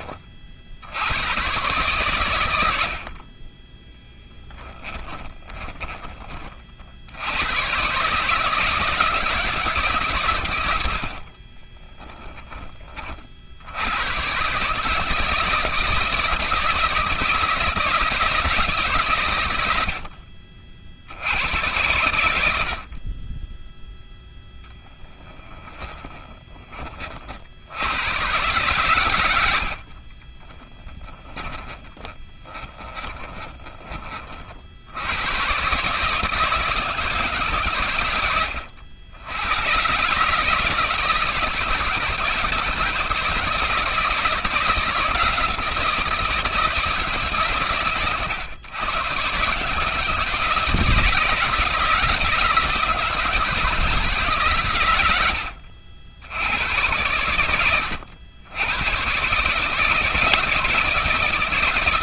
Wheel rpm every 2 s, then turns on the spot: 80, 60, 10, 70, 160, 60, 30, 150, 160, 130, 70, 50, 10, 40, 100, 10, 10, 90, 170, 90, 160, 160, 170, 150, 120, 160, 160, 100, 100, 130, 160.
4-6 10-12 24-26 28-34 54-56